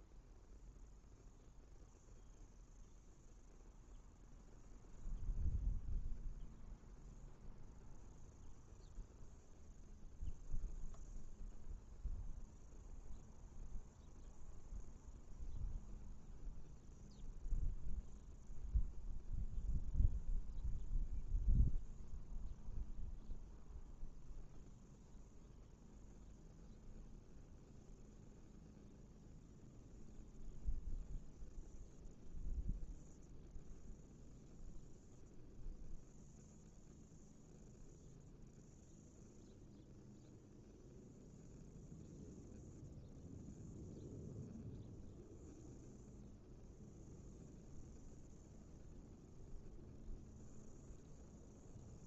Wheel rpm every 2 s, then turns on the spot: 0, 0, 0, 0, 0, 0, 0, 0, 0, 0, 0, 0, 0, 0, 0, 0, 0, 0, 0, 0, 0, 0, 0, 0, 0, 0.
none